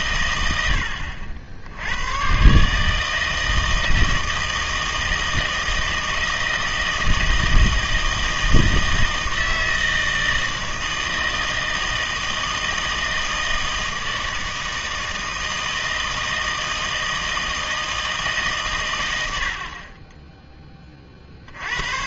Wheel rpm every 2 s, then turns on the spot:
110, 120, 160, 160, 160, 160, 160, 160, 160, 120, 40.
none